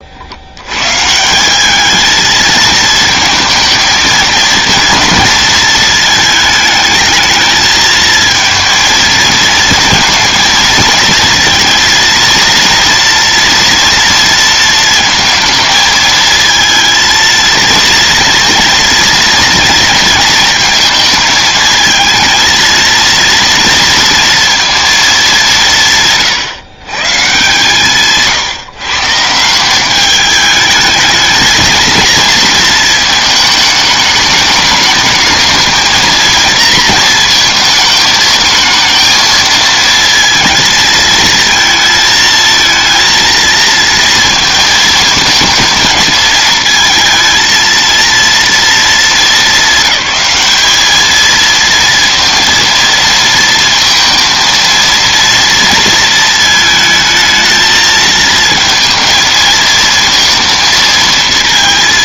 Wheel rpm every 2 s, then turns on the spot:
120, 220, 230, 220, 220, 230, 230, 230, 230, 230, 220, 230, 220, 140, 150, 220, 220, 220, 230, 220, 220, 230, 230, 230, 210, 210, 230, 230, 220, 220, 220.
none